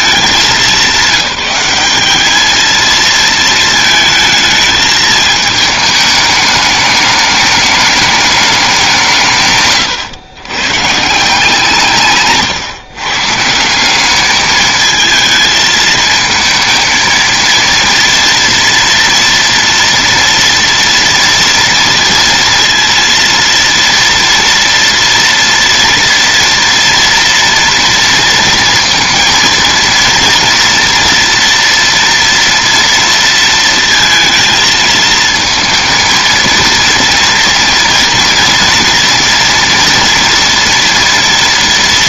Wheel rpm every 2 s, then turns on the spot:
200, 200, 220, 210, 210, 130, 120, 200, 220, 230, 240, 230, 230, 240, 230, 230, 230, 230, 230, 230, 230.
none